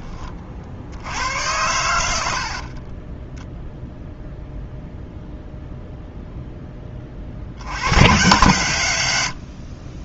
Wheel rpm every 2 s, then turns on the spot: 60, 50, 0, 10, 110.
2-4